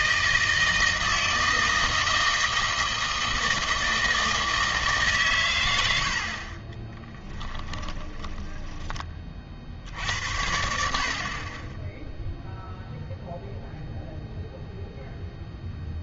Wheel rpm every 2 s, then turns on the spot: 160, 160, 150, 20, 10, 70, 0, 0.
6-10